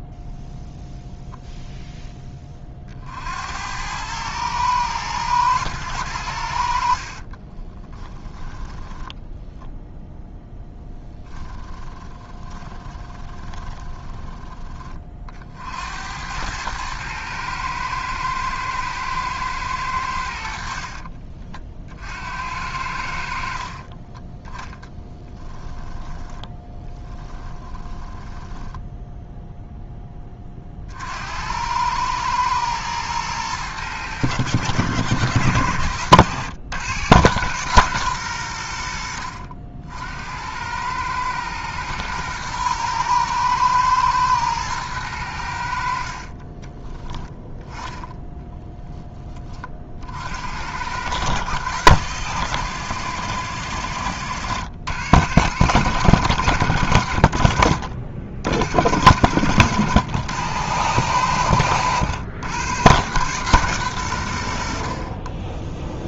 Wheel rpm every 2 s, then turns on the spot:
0, 30, 110, 70, 10, 0, 20, 20, 100, 110, 70, 70, 10, 10, 10, 30, 110, 100, 110, 100, 90, 110, 110, 30, 10, 80, 120, 100, 100, 70, 100, 110, 70.
8-10 12-14 26-30 46-48